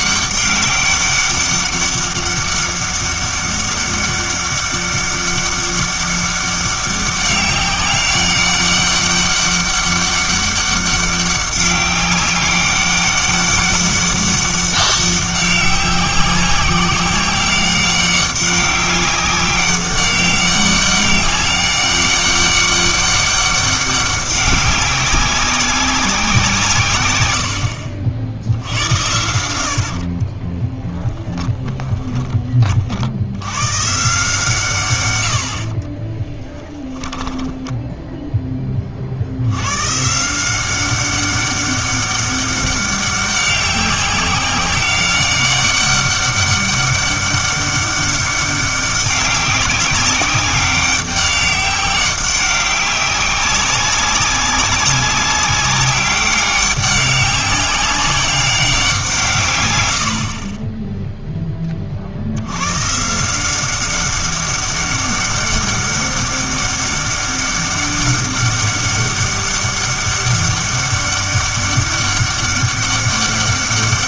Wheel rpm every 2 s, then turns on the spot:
200, 200, 200, 200, 200, 200, 200, 200, 190, 200, 200, 200, 190, 140, 70, 10, 40, 130, 10, 20, 190, 200, 190, 200, 200, 190, 190, 190, 200, 190, 20, 120, 200, 200, 200, 200, 200.
30-32 36-38